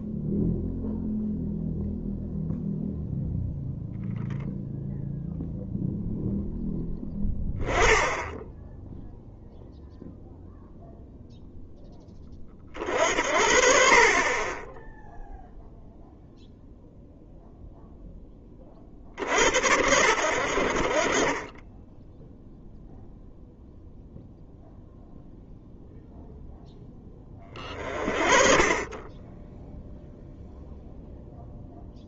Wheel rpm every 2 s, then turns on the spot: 0, 0, 0, 10, 10, 0, 40, 10, 0, 10, 70, 0, 0, 0, 30, 0.
none